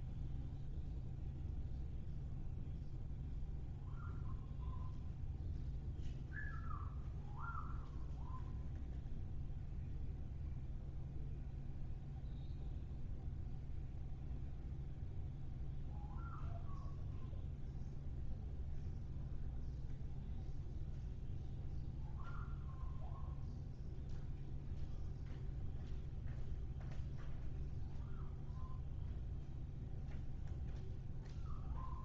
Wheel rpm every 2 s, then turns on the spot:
0, 0, 0, 0, 0, 0, 0, 0, 0, 0, 0, 0, 0, 0, 0, 0.
none